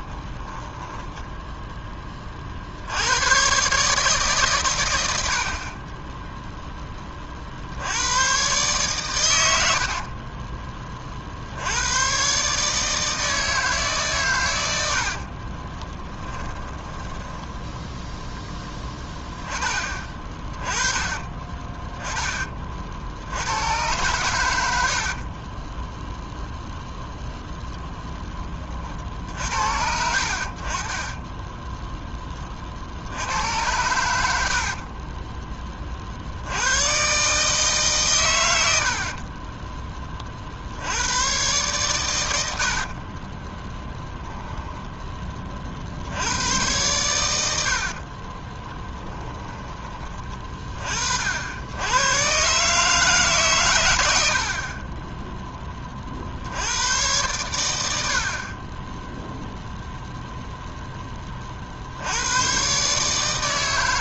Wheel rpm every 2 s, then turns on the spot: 20, 70, 110, 10, 120, 20, 150, 80, 10, 10, 20, 50, 70, 0, 40, 40, 60, 40, 110, 80, 80, 70, 20, 110, 20, 40, 150, 30, 100, 20, 10, 130.
0-2 24-26 34-36 42-46 48-50